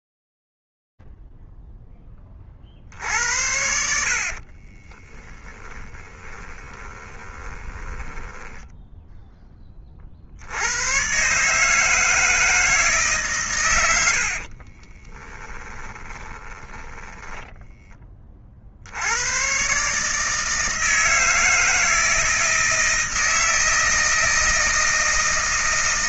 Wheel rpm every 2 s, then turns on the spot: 0, 20, 60, 20, 10, 90, 160, 40, 10, 80, 160, 160, 160.
4-10 14-18